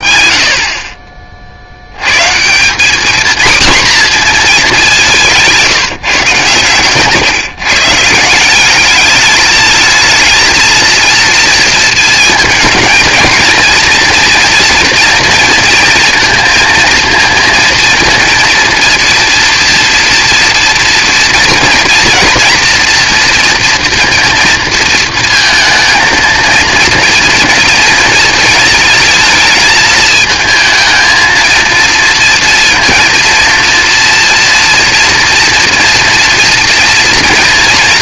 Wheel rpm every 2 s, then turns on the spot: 50, 210, 200, 130, 200, 230, 220, 240, 230, 230, 230, 230, 230, 220, 220, 220, 230, 230, 230.
6-8